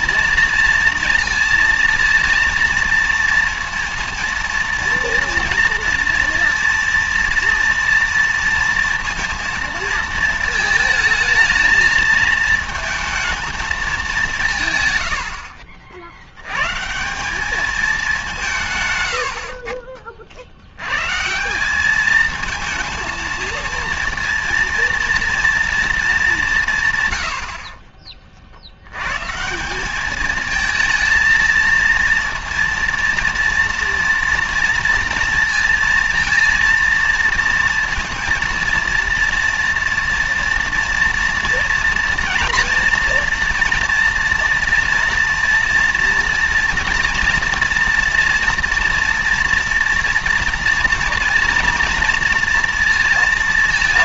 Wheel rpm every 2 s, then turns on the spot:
230, 230, 230, 230, 230, 220, 220, 130, 140, 140, 100, 230, 230, 140, 90, 220, 230, 230, 230, 230, 230, 230, 230, 230, 230, 230, 230.
none